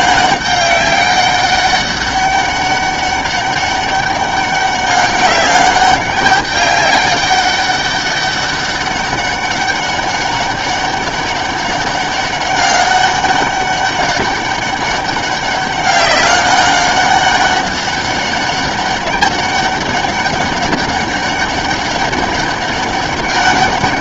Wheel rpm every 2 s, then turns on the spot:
200, 200, 190, 200, 200, 200, 190, 200, 200, 200, 200, 200.
none